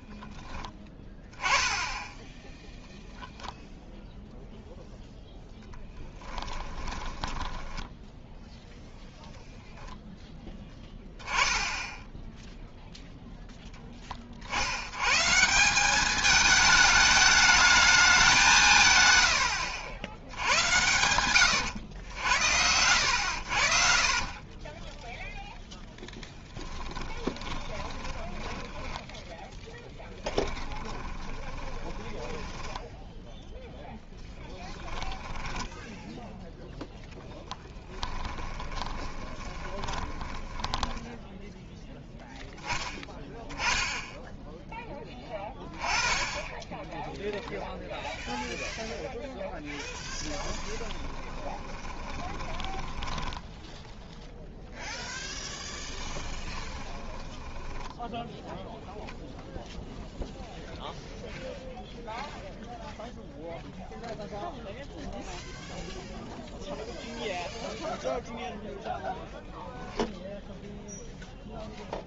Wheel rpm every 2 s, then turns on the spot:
10, 0, 0, 10, 0, 0, 0, 80, 220, 170, 90, 80, 20, 10, 10, 20, 10, 10, 0, 10, 10, 10, 10, 10, 0, 10, 20, 0, 20, 0, 0, 0, 0, 0, 0, 0.
6-8 24-36 38-40 50-54 56-58